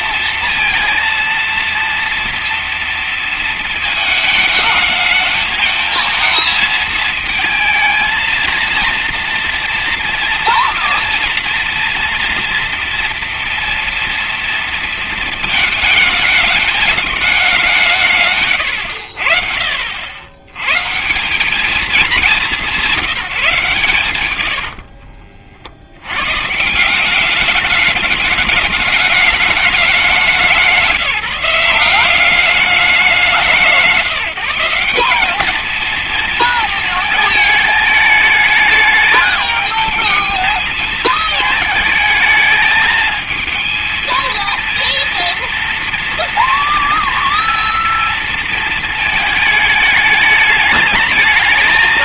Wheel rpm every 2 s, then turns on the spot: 230, 230, 220, 230, 230, 230, 230, 230, 220, 120, 100, 200, 100, 130, 210, 180, 190, 160, 230, 210, 220, 220, 230, 240, 230, 210.
24-26